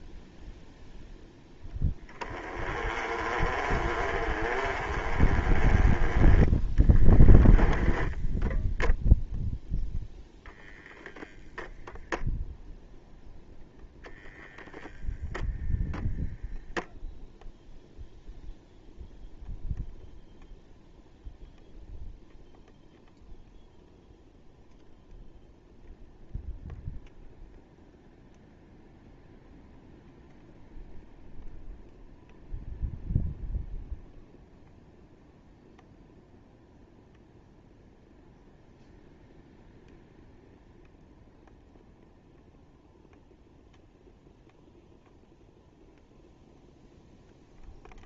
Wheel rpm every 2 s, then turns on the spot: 0, 20, 30, 10, 0, 0, 0, 0, 0, 0, 0, 0, 0, 0, 0, 0, 0, 0, 0, 0, 0, 0, 0, 0.
6-8